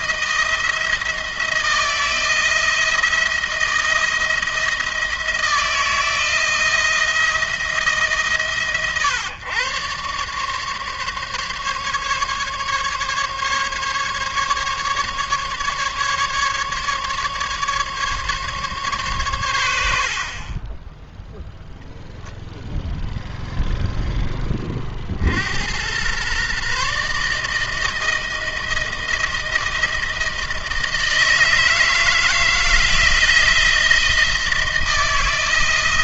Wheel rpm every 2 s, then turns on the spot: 160, 160, 170, 170, 130, 140, 140, 140, 150, 140, 30, 0, 20, 130, 160, 160, 160, 160.
none